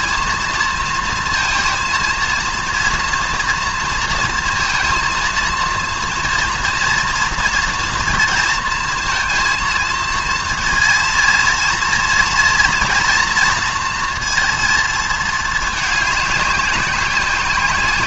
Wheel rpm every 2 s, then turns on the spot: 230, 230, 230, 240, 230, 230, 240, 230, 200.
none